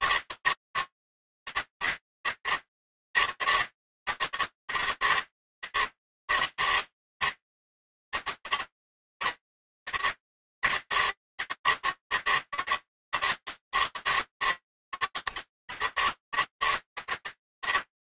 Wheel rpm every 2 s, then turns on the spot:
160, 160, 150, 150, 160, 150, 160, 150, 120.
none